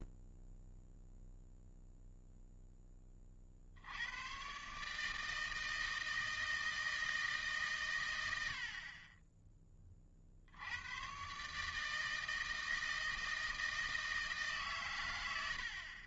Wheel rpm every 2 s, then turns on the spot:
0, 10, 140, 160, 60, 80, 160, 130.
none